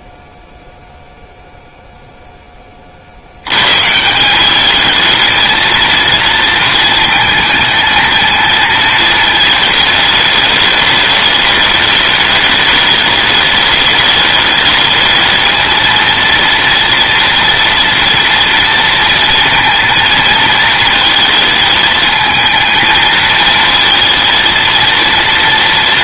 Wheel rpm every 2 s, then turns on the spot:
0, 0, 180, 230, 220, 210, 210, 210, 230, 230, 220, 220, 230.
none